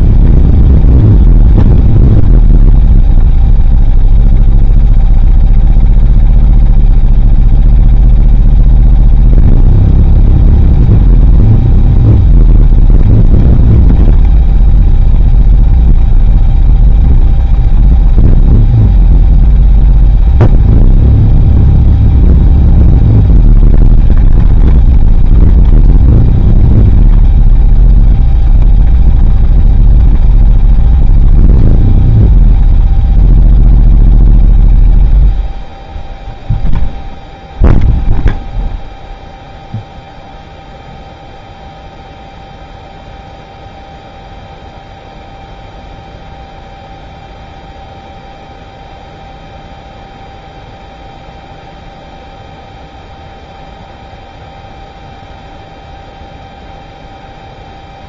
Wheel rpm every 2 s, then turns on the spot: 0, 0, 0, 0, 0, 0, 0, 0, 0, 0, 0, 0, 0, 0, 0, 0, 0, 0, 0, 0, 0, 0, 0, 0, 0, 0, 0, 0, 0.
none